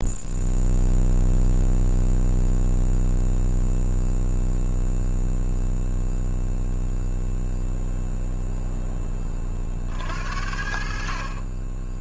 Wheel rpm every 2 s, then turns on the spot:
0, 0, 0, 0, 10, 50.
none